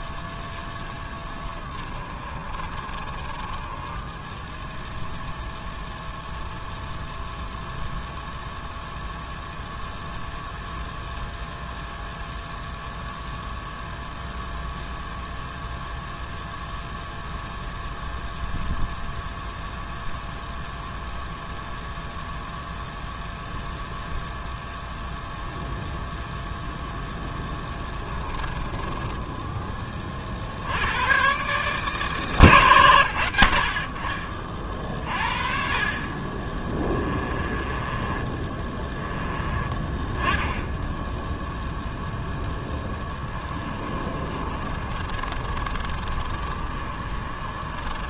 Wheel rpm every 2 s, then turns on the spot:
10, 30, 0, 0, 0, 0, 0, 0, 0, 0, 0, 0, 0, 0, 20, 100, 120, 40, 20, 20, 0, 10, 30, 30.
0-4 28-30 36-38 42-48